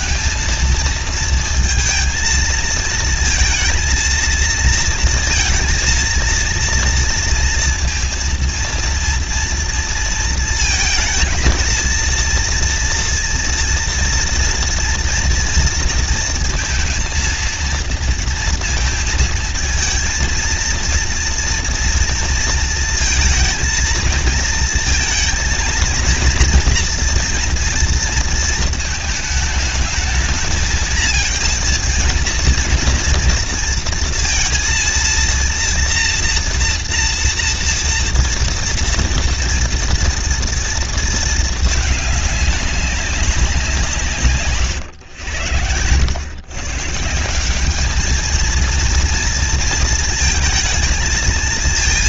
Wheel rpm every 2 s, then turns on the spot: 220, 230, 230, 230, 230, 230, 230, 230, 230, 230, 230, 230, 220, 230, 230, 230, 230, 230, 230, 230, 230, 200, 130, 140, 230, 220.
44-46